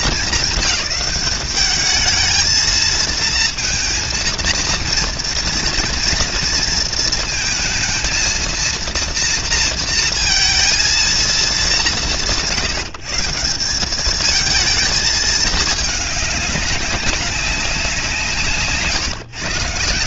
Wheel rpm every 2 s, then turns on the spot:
210, 230, 230, 230, 230, 230, 160, 220, 200, 130.
none